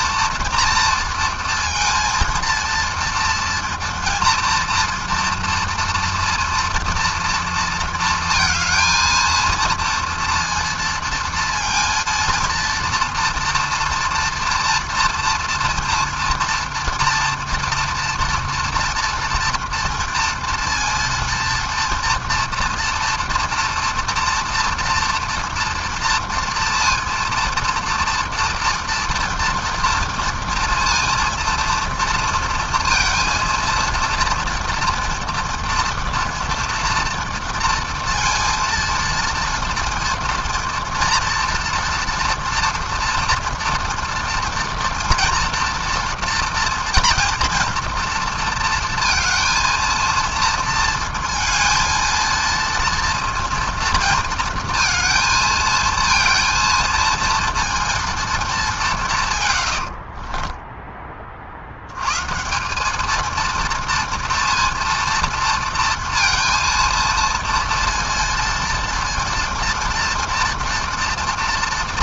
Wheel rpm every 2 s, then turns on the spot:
230, 230, 230, 230, 220, 230, 230, 230, 230, 230, 230, 230, 230, 230, 230, 230, 230, 240, 230, 230, 230, 230, 230, 240, 230, 230, 230, 230, 230, 210, 10, 180, 230, 230, 230, 240.
60-62